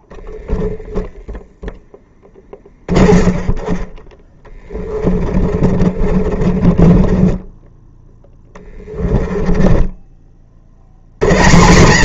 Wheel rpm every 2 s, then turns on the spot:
0, 30, 20, 30, 10, 90.
4-8